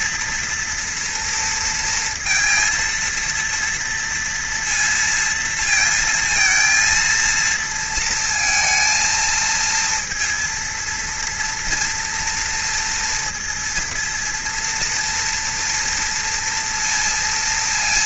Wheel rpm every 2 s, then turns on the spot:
230, 230, 230, 230, 220, 240, 240, 230, 230.
none